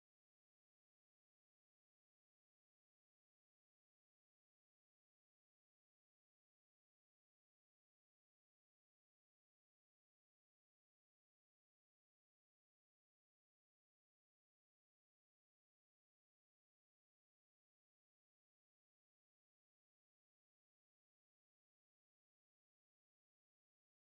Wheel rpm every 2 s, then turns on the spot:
10, 0, 10, 10, 0, 0, 0, 0, 0, 0, 110, 120.
0-2 4-8